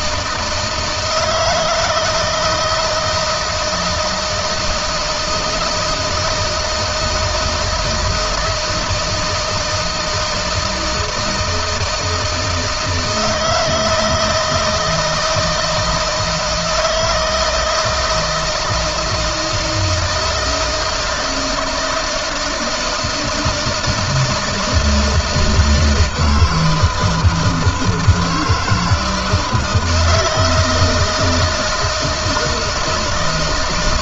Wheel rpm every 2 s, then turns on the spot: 160, 160, 160, 170, 160, 160, 160, 160, 160, 160, 160, 160, 160, 160, 160, 160, 160.
none